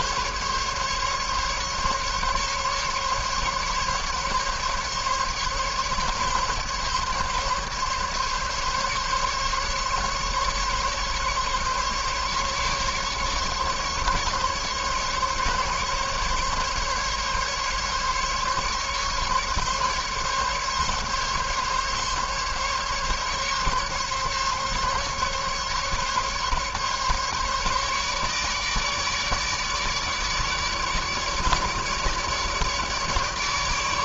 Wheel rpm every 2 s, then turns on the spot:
140, 140, 140, 140, 140, 140, 140, 140, 140, 140, 140, 140, 140, 140, 150, 150, 150.
none